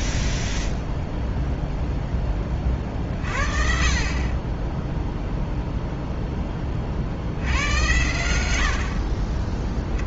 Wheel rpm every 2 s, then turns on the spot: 0, 30, 10, 30, 70.
8-10